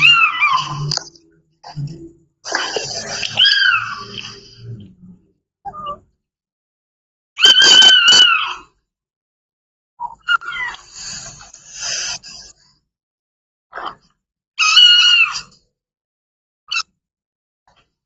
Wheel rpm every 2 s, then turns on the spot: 0, 0, 0, 0, 0, 0, 0, 0, 0.
none